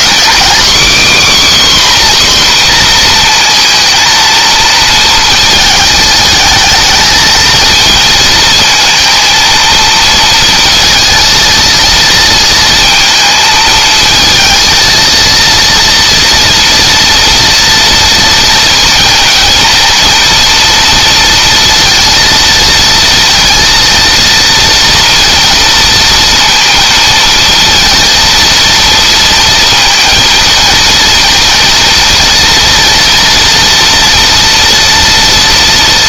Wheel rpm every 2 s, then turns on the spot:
270, 240, 220, 220, 220, 230, 220, 230, 230, 230, 230, 230, 230, 230, 230, 220, 230, 230.
none